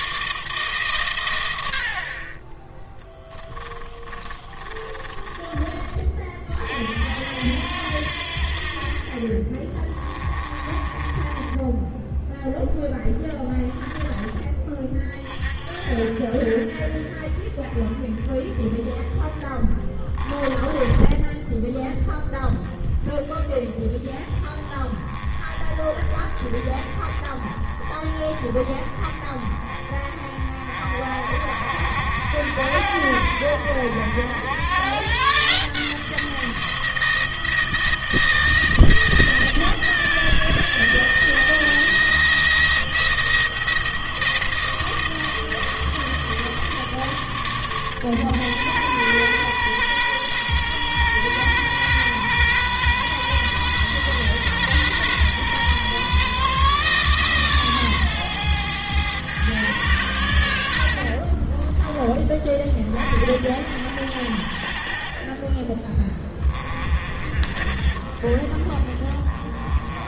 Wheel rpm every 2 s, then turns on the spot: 130, 20, 20, 60, 50, 30, 10, 40, 40, 20, 10, 20, 20, 20, 20, 40, 70, 130, 170, 170, 160, 170, 170, 160, 130, 120, 130, 120, 140, 120, 70, 40, 40, 40, 30.
2-6 10-12 20-22 60-62 64-66